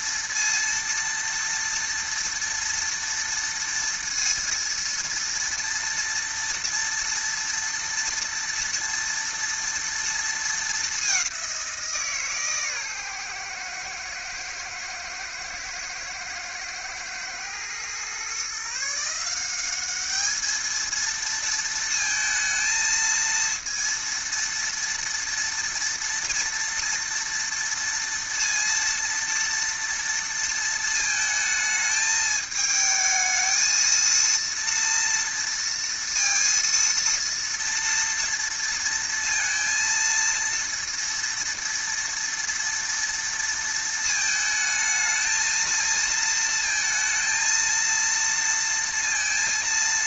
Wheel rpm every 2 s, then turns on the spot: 230, 230, 230, 230, 230, 220, 150, 120, 110, 130, 210, 230, 230, 230, 230, 230, 220, 230, 230, 230, 230, 230, 220, 220, 230.
none